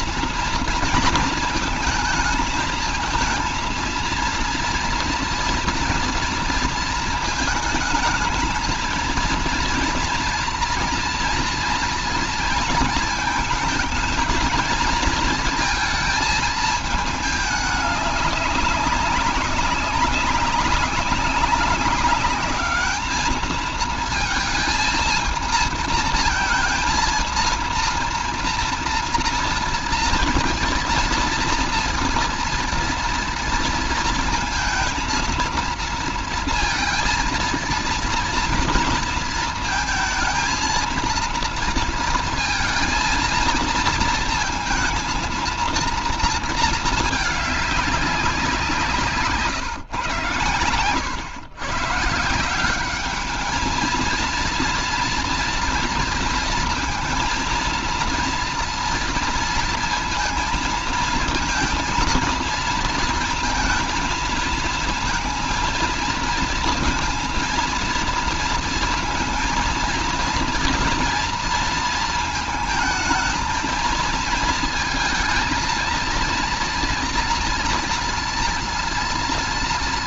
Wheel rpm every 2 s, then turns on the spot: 230, 220, 230, 230, 220, 230, 230, 220, 220, 210, 200, 200, 230, 230, 240, 230, 230, 230, 230, 230, 230, 230, 230, 230, 190, 120, 180, 230, 230, 230, 230, 230, 230, 230, 230, 230, 220, 230, 230, 230.
none